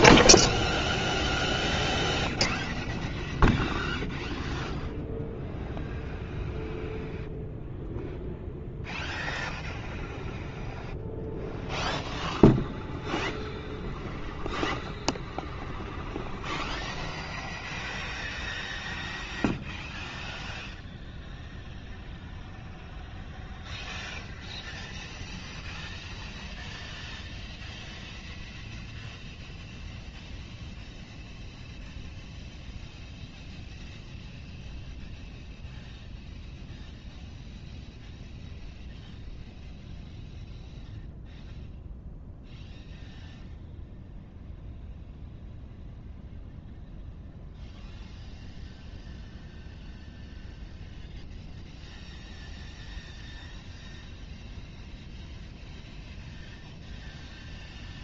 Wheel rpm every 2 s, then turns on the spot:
0, 0, 0, 0, 0, 0, 0, 0, 0, 0, 0, 0, 0, 0, 0, 0, 0, 0, 0, 0, 0, 0, 0, 0, 0, 0, 0, 0, 0.
none